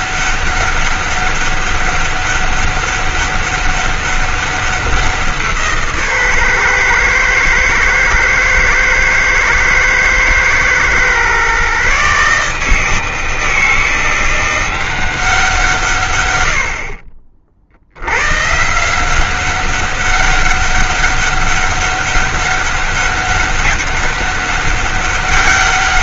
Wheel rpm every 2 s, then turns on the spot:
190, 200, 190, 120, 110, 120, 150, 180, 70, 150, 200, 200, 200.
none